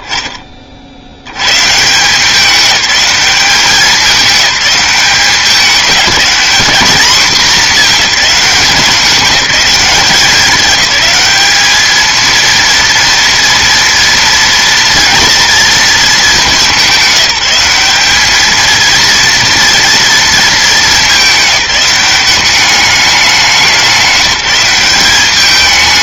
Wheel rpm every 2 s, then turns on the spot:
30, 190, 200, 200, 210, 200, 230, 230, 210, 220, 220, 200, 180.
none